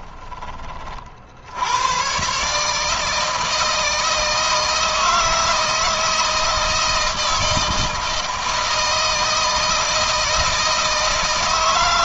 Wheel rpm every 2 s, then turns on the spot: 40, 150, 160, 160, 160, 160.
none